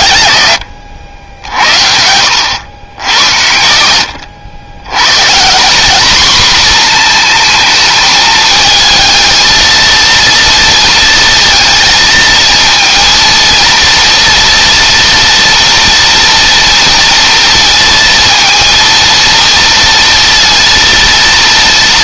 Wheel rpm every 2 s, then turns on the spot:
90, 100, 120, 230, 220, 230, 230, 240, 230, 230, 230.
none